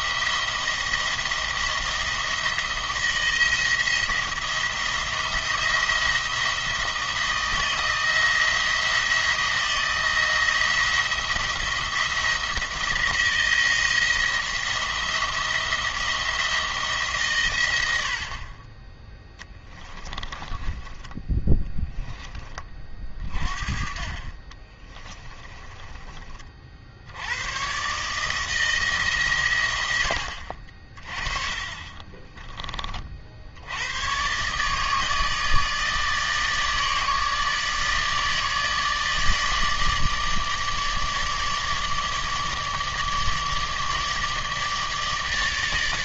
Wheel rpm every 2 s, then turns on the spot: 170, 170, 170, 170, 170, 170, 170, 170, 160, 40, 20, 30, 30, 50, 160, 50, 30, 140, 150, 160, 150, 150, 150.
20-22 24-26